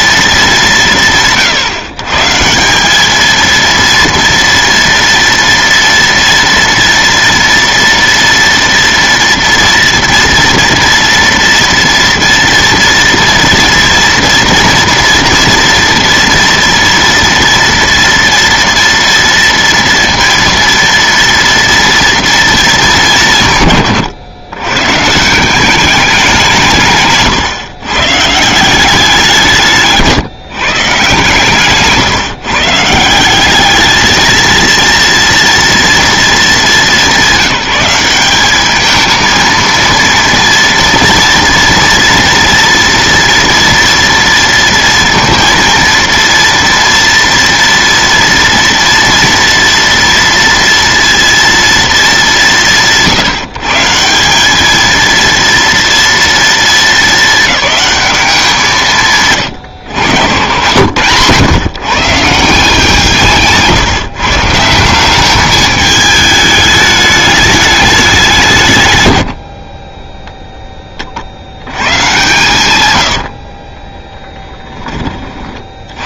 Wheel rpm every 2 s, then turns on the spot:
180, 180, 230, 230, 230, 230, 230, 230, 230, 230, 230, 220, 130, 170, 180, 140, 150, 230, 220, 210, 230, 230, 230, 230, 230, 230, 170, 210, 230, 180, 110, 160, 170, 210, 150, 10, 110, 20.
none